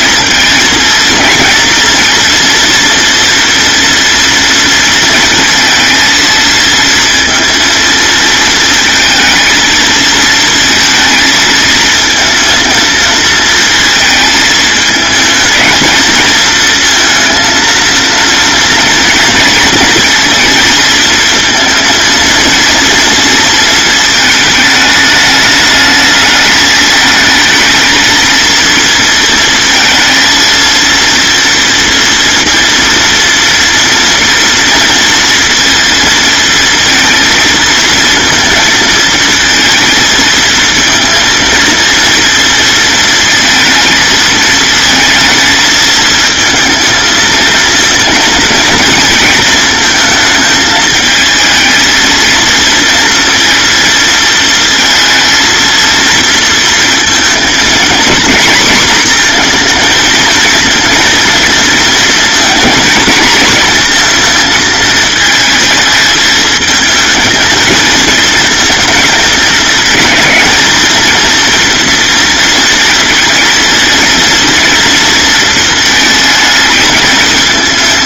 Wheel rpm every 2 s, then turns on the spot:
230, 230, 230, 230, 220, 230, 230, 220, 230, 230, 220, 230, 220, 220, 230, 230, 230, 230, 230, 230, 230, 230, 230, 230, 220, 220, 230, 230, 230, 240, 230, 230, 220, 220, 220, 220, 230, 230, 220.
none